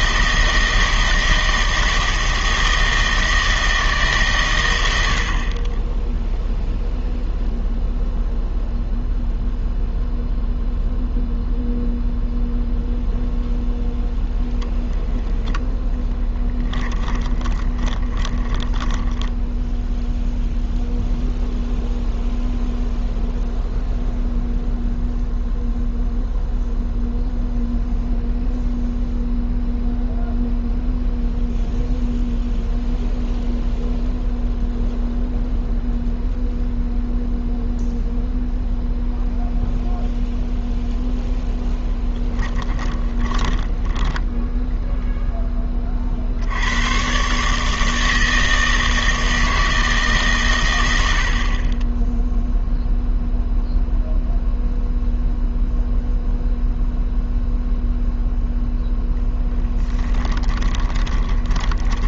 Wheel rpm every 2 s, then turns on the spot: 160, 160, 90, 0, 0, 0, 0, 0, 20, 20, 0, 0, 0, 0, 0, 0, 0, 0, 0, 0, 0, 20, 10, 100, 160, 110, 0, 0, 0, 0, 20.
16-20 42-46 60-62